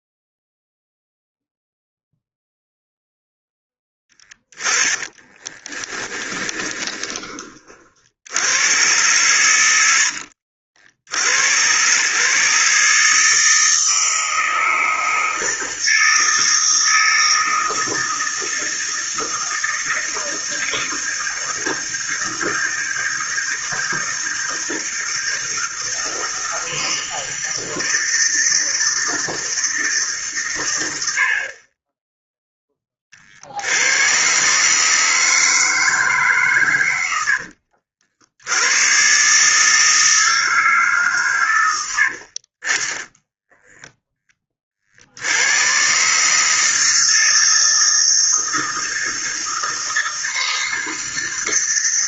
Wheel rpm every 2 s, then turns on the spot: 0, 0, 10, 30, 110, 80, 150, 160, 160, 160, 160, 160, 160, 160, 160, 100, 20, 150, 120, 110, 150, 20, 40, 160, 160, 160.
4-8